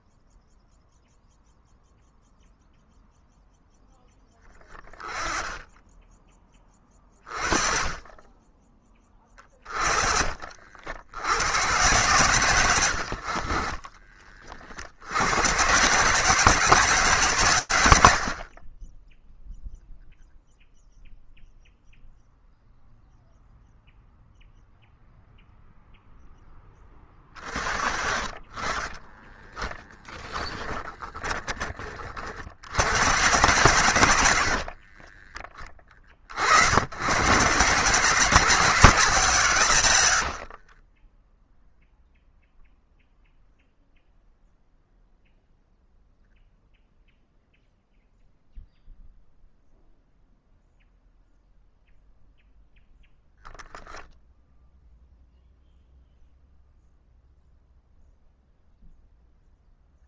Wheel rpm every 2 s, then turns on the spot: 0, 0, 10, 20, 20, 50, 110, 70, 150, 20, 0, 0, 0, 20, 20, 20, 90, 30, 120, 150, 10, 0, 0, 0, 0, 0, 0, 0, 0, 0.
28-32 34-36 40-42